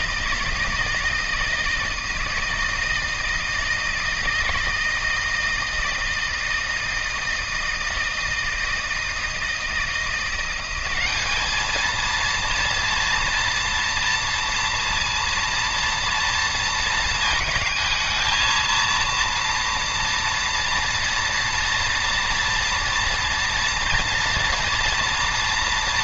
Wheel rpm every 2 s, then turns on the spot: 160, 160, 160, 160, 160, 190, 230, 230, 230, 230, 230, 230, 240.
none